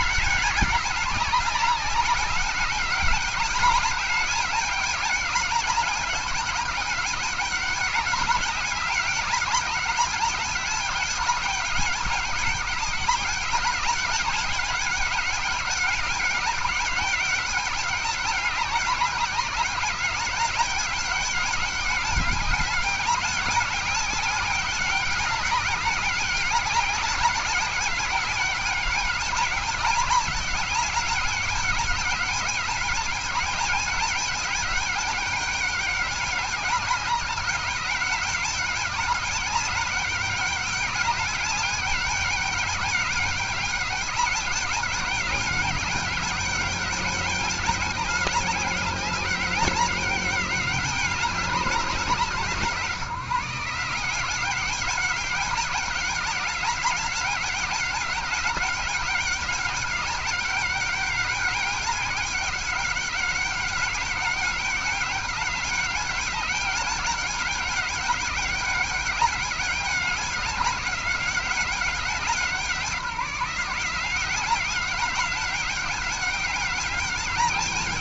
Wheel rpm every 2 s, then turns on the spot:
190, 200, 200, 200, 200, 200, 200, 200, 190, 200, 200, 200, 190, 200, 200, 200, 200, 200, 200, 200, 200, 200, 200, 200, 200, 200, 160, 190, 200, 200, 200, 190, 200, 200, 200, 200, 180, 190, 200.
none